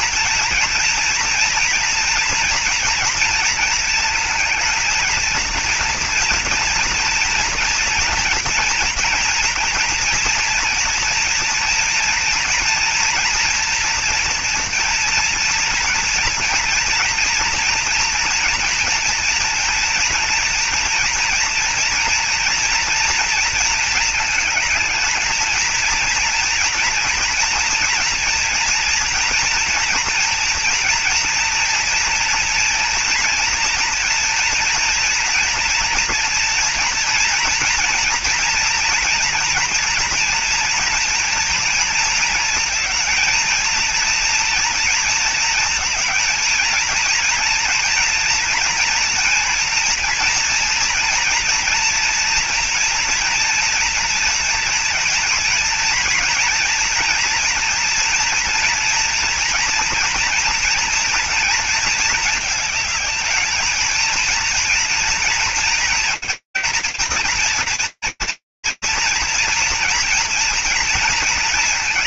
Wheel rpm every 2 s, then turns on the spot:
230, 230, 230, 230, 230, 230, 240, 230, 230, 230, 230, 230, 220, 230, 230, 230, 240, 230, 230, 230, 240, 230, 230, 230, 230, 230, 240, 230, 230, 230, 230, 220, 230, 230, 230, 230.
none